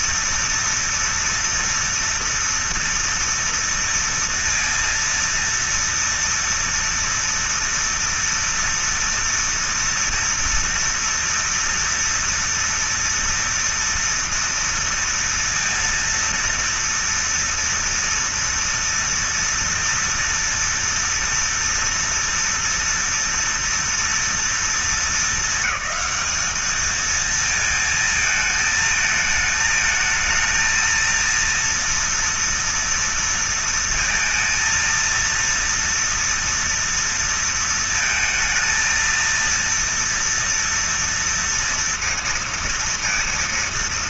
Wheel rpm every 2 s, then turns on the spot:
230, 230, 230, 230, 230, 230, 230, 230, 230, 230, 230, 230, 230, 210, 220, 220, 230, 230, 230, 230, 230, 230.
none